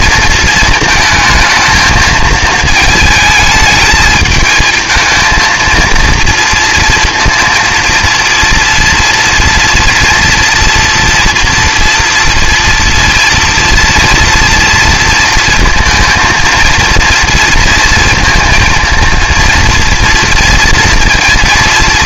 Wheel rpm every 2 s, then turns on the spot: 220, 220, 220, 230, 230, 240, 230, 230, 230, 230, 230.
none